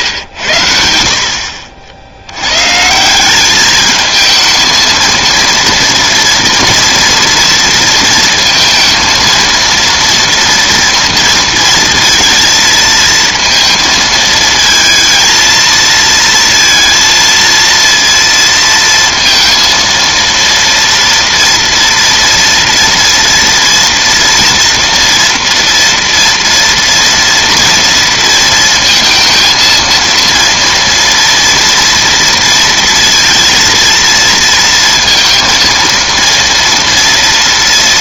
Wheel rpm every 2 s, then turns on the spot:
70, 150, 230, 230, 230, 230, 230, 230, 230, 230, 230, 230, 230, 230, 230, 230, 230, 230, 230.
none